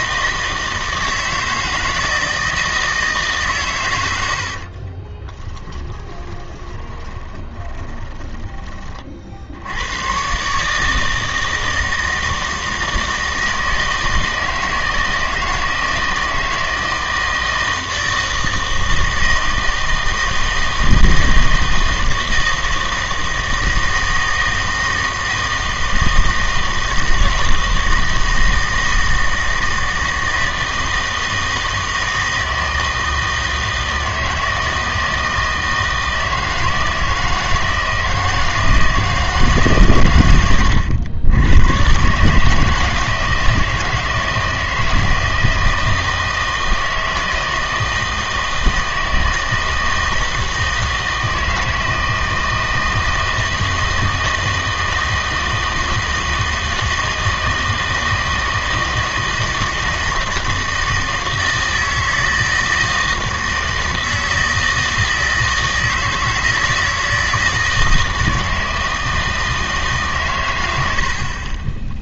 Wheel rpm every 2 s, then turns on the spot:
160, 160, 50, 20, 30, 150, 160, 160, 160, 160, 160, 160, 160, 160, 160, 160, 160, 160, 160, 160, 100, 160, 160, 160, 160, 160, 160, 160, 160, 160, 160, 160, 160, 160, 160, 110.
4-8